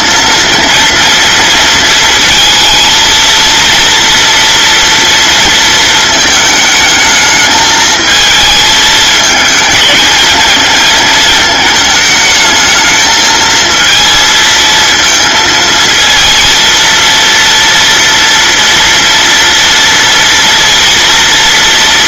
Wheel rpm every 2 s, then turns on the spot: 230, 230, 230, 220, 220, 220, 220, 230, 230, 230, 230.
none